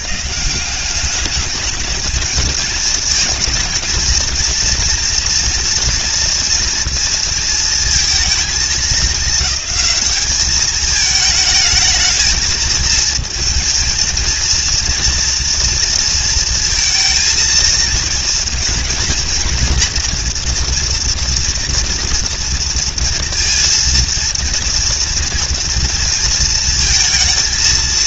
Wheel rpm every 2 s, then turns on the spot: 180, 220, 240, 230, 220, 210, 220, 230, 230, 230, 230, 230, 230, 220.
none